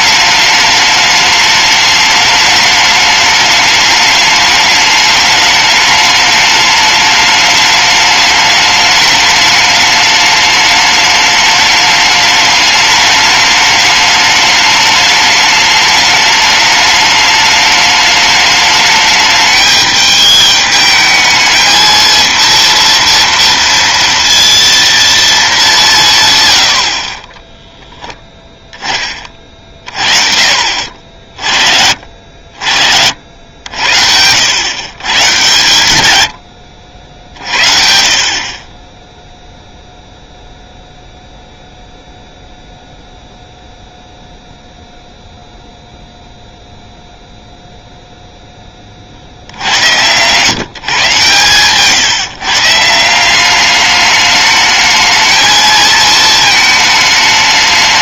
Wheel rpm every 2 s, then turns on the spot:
210, 210, 210, 210, 210, 210, 210, 210, 210, 210, 210, 230, 230, 60, 20, 50, 70, 120, 70, 20, 0, 0, 0, 0, 40, 130, 170, 220, 220.
none